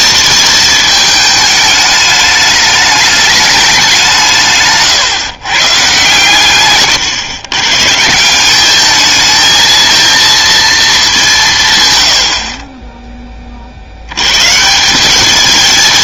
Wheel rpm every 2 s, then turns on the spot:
220, 210, 150, 130, 200, 220, 40, 150.
none